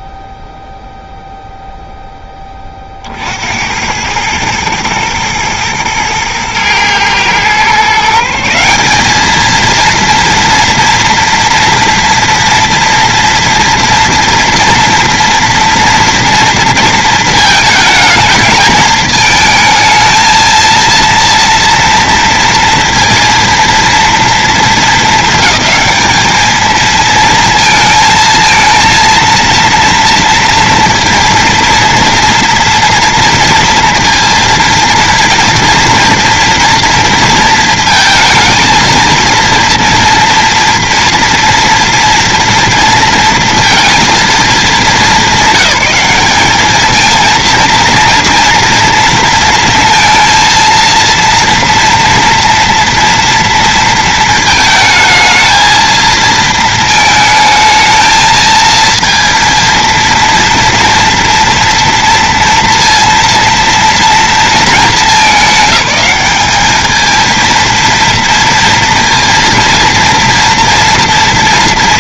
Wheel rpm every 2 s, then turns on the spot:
0, 30, 110, 120, 190, 230, 240, 230, 230, 220, 230, 230, 210, 220, 230, 230, 240, 230, 230, 230, 230, 230, 210, 210, 230, 230, 230, 220, 220, 230, 230, 230, 210, 210, 230, 230.
none